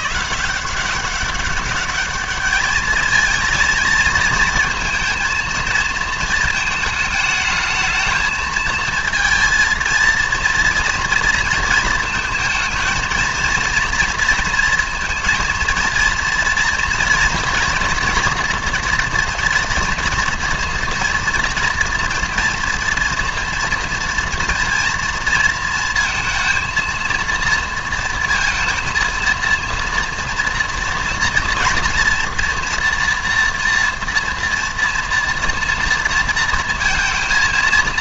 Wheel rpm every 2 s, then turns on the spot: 170, 210, 230, 220, 220, 230, 220, 230, 230, 230, 230, 230, 230, 230, 230, 230, 230, 230, 230.
none